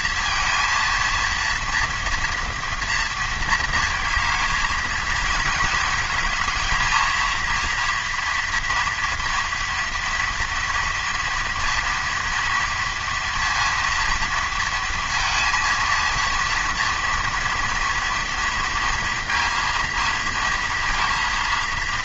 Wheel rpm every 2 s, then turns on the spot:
230, 230, 230, 220, 230, 230, 230, 230, 230, 230, 230.
none